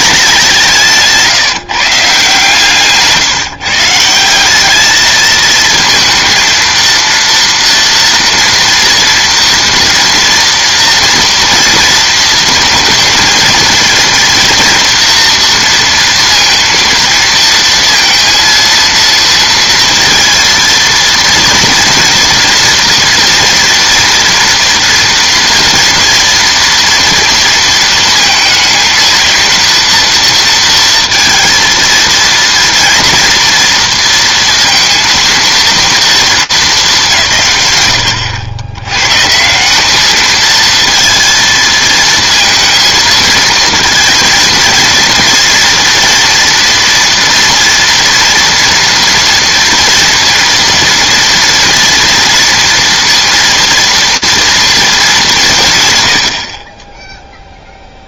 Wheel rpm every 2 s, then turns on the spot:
180, 140, 190, 230, 230, 230, 230, 230, 230, 230, 230, 230, 230, 230, 230, 230, 230, 230, 210, 100, 230, 230, 230, 230, 230, 230, 230, 230, 30.
none